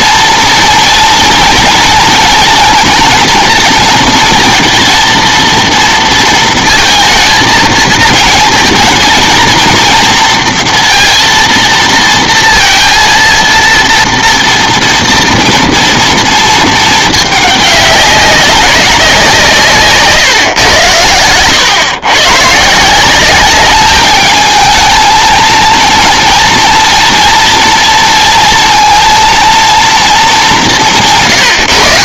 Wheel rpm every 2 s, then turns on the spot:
240, 230, 230, 230, 220, 230, 230, 230, 220, 200, 120, 140, 220, 230, 230, 190.
none